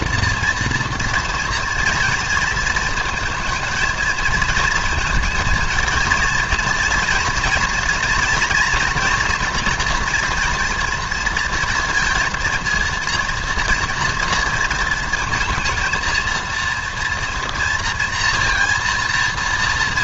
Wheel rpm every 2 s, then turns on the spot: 230, 230, 220, 230, 230, 230, 230, 230, 230, 230.
none